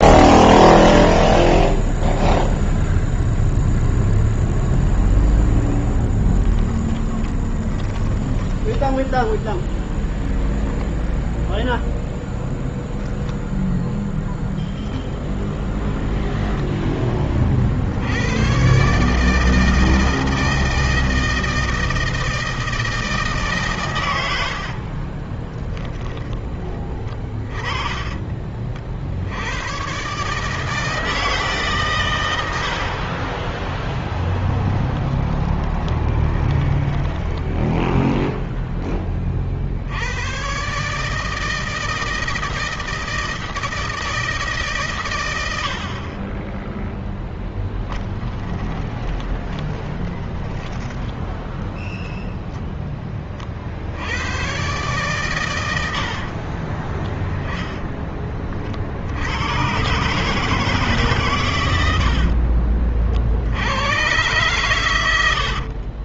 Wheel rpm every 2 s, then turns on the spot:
0, 0, 0, 10, 10, 0, 0, 0, 0, 110, 160, 160, 90, 30, 30, 150, 90, 10, 10, 0, 110, 160, 150, 20, 10, 20, 10, 120, 40, 30, 150, 60, 120.
6-10 24-26 34-38 48-50 56-58 62-64